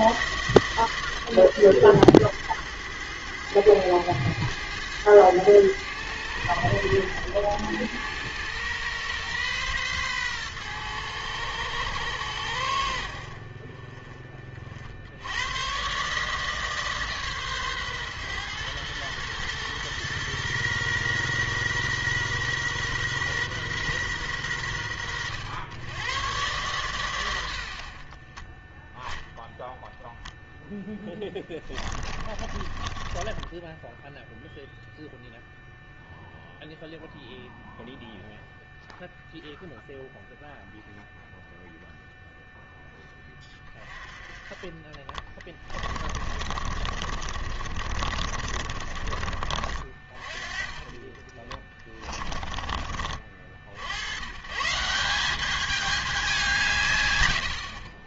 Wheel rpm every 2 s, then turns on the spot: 160, 110, 110, 100, 110, 110, 90, 40, 150, 120, 120, 120, 110, 120, 10, 0, 20, 0, 0, 0, 0, 0, 20, 40, 50, 20, 30, 130, 170.
28-30 32-34 44-50 52-54